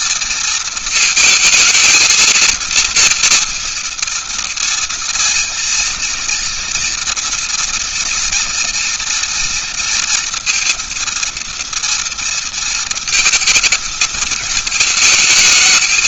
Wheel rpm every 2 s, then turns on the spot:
230, 230, 230, 230, 230, 230, 230, 220.
none